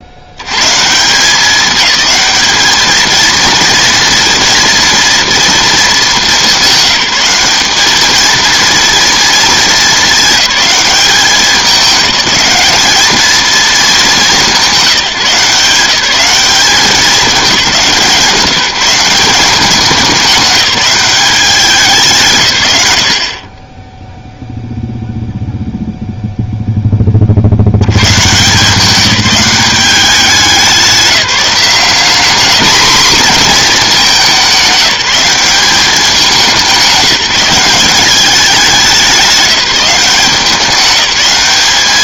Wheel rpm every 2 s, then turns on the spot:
140, 220, 230, 200, 230, 210, 210, 190, 190, 170, 200, 110, 0, 10, 160, 190, 220, 190, 190, 200, 190.
none